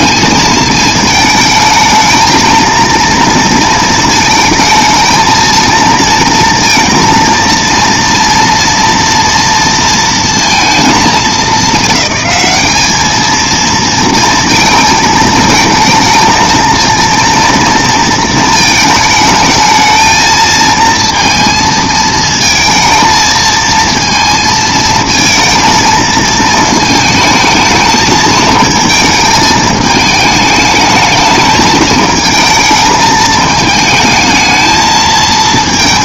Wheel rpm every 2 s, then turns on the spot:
220, 230, 220, 230, 230, 230, 210, 230, 220, 220, 230, 220, 220, 220, 220, 210, 220, 220.
none